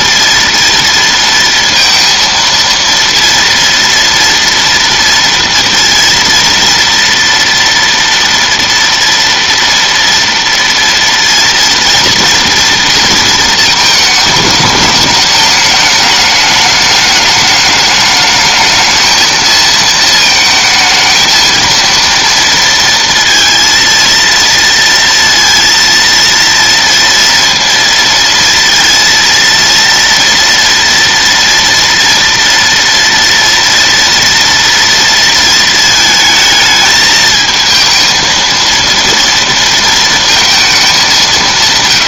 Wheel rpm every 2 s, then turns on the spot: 230, 230, 230, 230, 230, 230, 240, 210, 210, 210, 220, 230, 230, 230, 230, 230, 230, 230, 220, 230, 220.
none